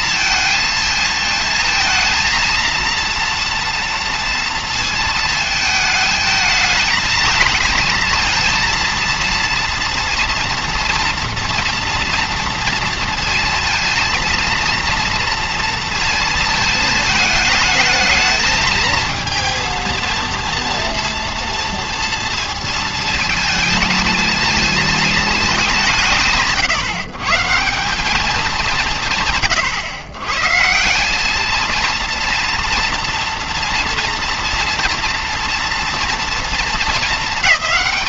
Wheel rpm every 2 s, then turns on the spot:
220, 230, 230, 220, 230, 230, 230, 230, 220, 220, 230, 230, 220, 150, 200, 140, 230, 230, 230.
none